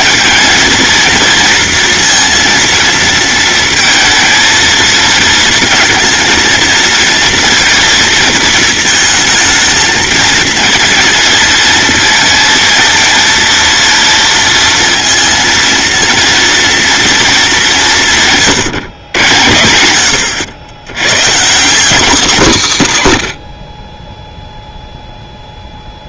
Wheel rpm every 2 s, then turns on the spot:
230, 230, 230, 230, 220, 230, 230, 230, 230, 140, 100, 140, 0.
none